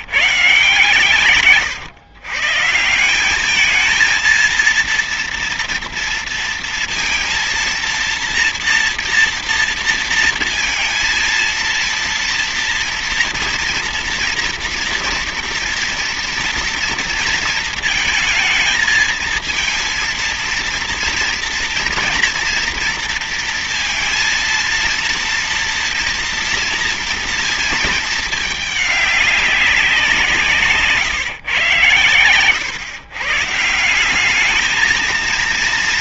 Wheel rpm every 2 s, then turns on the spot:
150, 150, 230, 230, 230, 230, 230, 230, 230, 220, 230, 230, 230, 230, 210, 150, 110, 210.
none